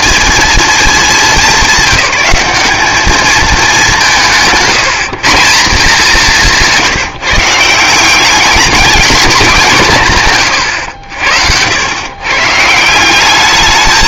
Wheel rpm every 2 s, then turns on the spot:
220, 200, 170, 180, 210, 110, 160.
none